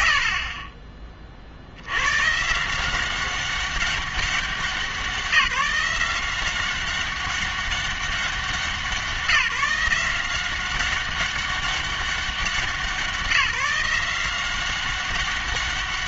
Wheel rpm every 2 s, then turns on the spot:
70, 160, 190, 190, 180, 190, 180, 190.
none